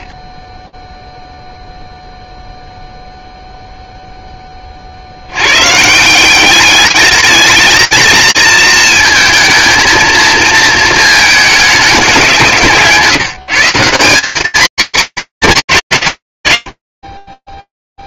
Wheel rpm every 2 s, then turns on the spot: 50, 0, 20, 200, 230, 230, 180, 210, 110.
none